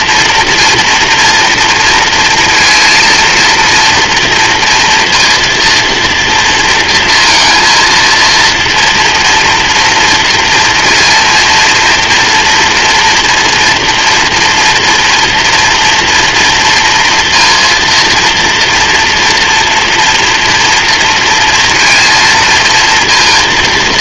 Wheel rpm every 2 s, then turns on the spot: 230, 230, 230, 230, 230, 230, 230, 230, 230, 230, 230, 230.
none